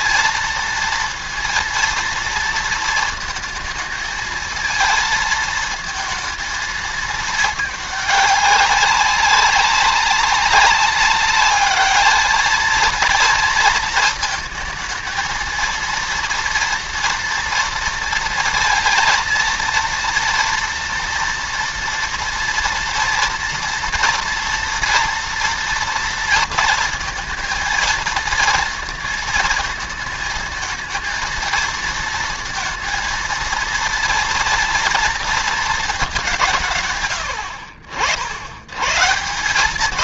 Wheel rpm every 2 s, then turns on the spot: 230, 230, 220, 220, 200, 200, 220, 220, 230, 230, 230, 230, 230, 230, 230, 220, 230, 230, 150, 110.
none